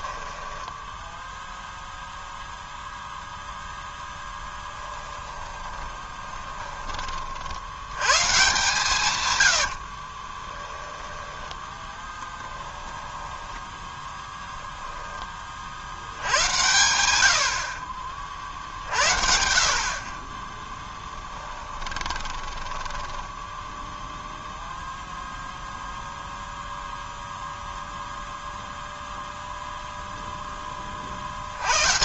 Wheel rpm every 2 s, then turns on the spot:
10, 0, 10, 20, 150, 10, 10, 10, 90, 60, 10, 10, 0, 0, 0, 20.
0-2 4-6 20-24